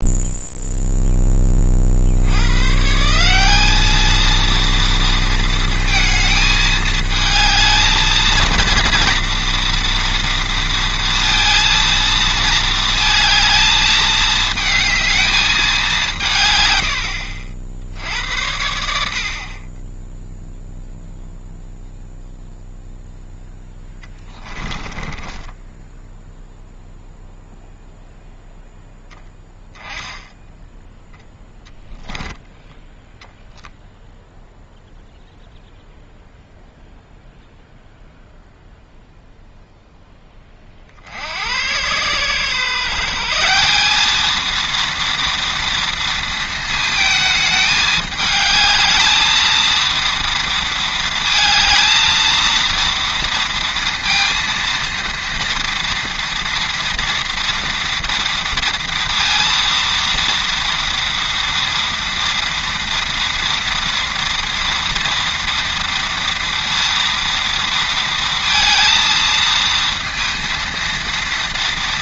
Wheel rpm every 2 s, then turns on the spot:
0, 140, 230, 220, 230, 230, 220, 220, 120, 70, 0, 0, 10, 0, 0, 0, 20, 0, 0, 0, 40, 140, 230, 220, 220, 230, 230, 230, 230, 230, 230, 230, 230, 230, 230, 230.
24-26